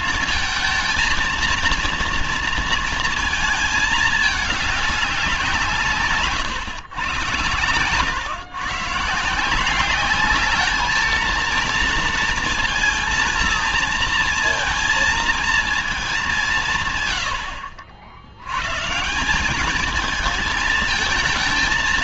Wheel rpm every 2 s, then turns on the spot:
230, 230, 200, 120, 140, 220, 230, 230, 150, 140, 220.
none